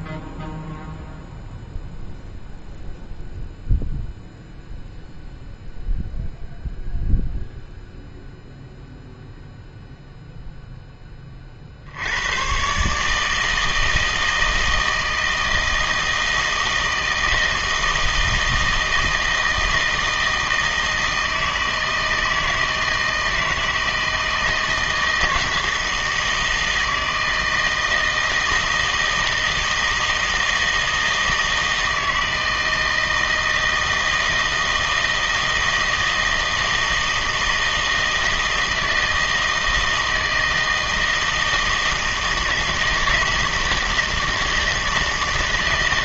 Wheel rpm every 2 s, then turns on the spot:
0, 0, 0, 0, 0, 0, 130, 160, 160, 160, 160, 160, 160, 160, 160, 160, 160, 160, 160, 160, 160, 160, 160.
none